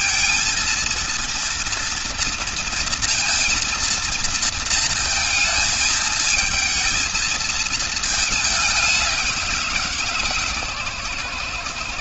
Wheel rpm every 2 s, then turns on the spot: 230, 230, 230, 220, 200, 140.
none